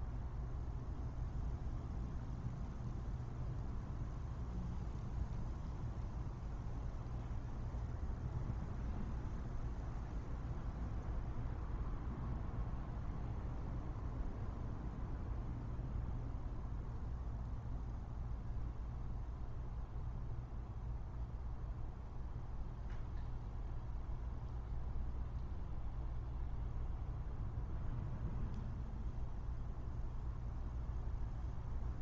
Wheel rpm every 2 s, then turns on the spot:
0, 0, 0, 0, 0, 0, 0, 0, 0, 0, 0, 0, 0, 0, 0, 0.
none